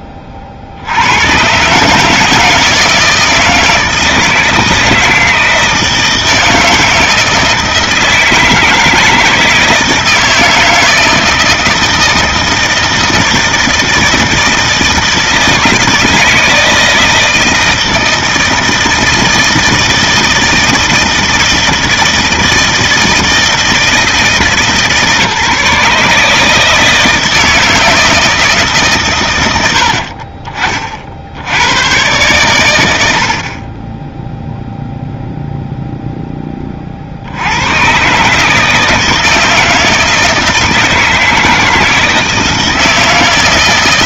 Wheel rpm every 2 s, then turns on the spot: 80, 160, 160, 160, 160, 160, 160, 160, 160, 160, 160, 160, 150, 160, 140, 40, 90, 0, 50, 160, 160, 160.
none